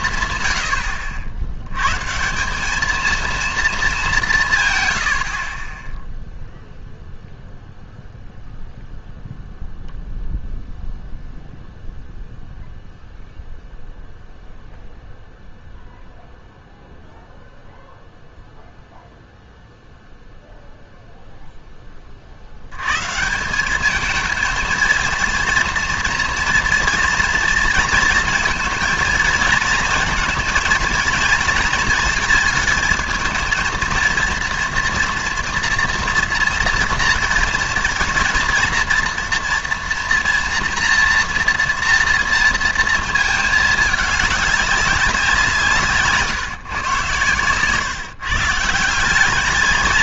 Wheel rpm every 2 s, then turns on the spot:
110, 180, 150, 0, 0, 0, 0, 0, 0, 0, 0, 80, 220, 230, 230, 220, 220, 230, 230, 230, 240, 230, 200, 140, 160.
none